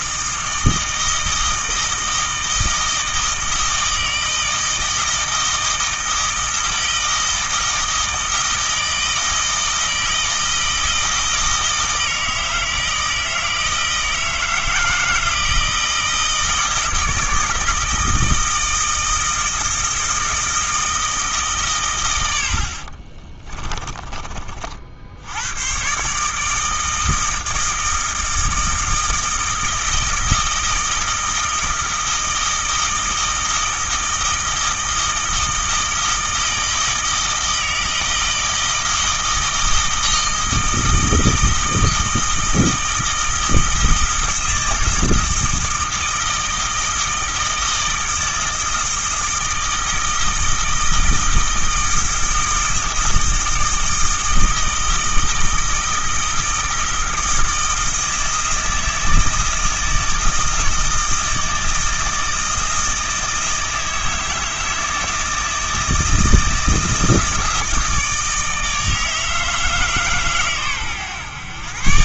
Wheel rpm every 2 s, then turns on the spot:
160, 160, 160, 160, 160, 160, 160, 160, 160, 160, 160, 50, 50, 160, 160, 160, 160, 160, 160, 160, 160, 160, 160, 160, 160, 160, 160, 160, 160, 160, 160, 160, 160, 160, 160, 120.
22-24